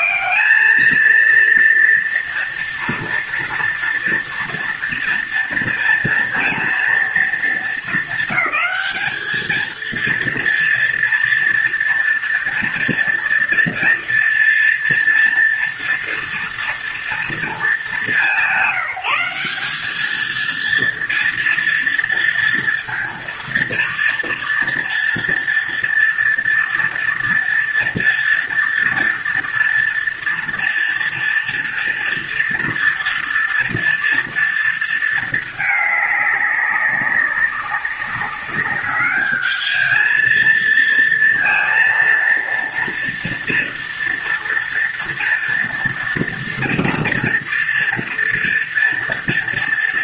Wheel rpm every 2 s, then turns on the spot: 220, 230, 230, 230, 220, 230, 230, 230, 230, 200, 230, 230, 240, 230, 230, 230, 240, 230, 200, 200, 230, 230, 230, 230, 230.
none